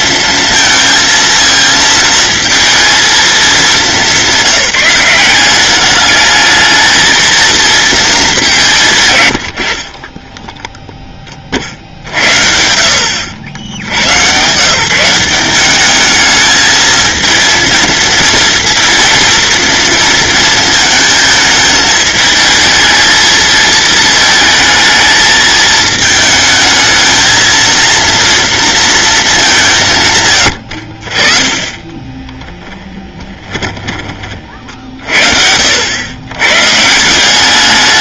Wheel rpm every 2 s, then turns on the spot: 230, 230, 190, 220, 150, 10, 60, 150, 220, 230, 220, 220, 220, 220, 230, 60, 10, 50, 140.
32-34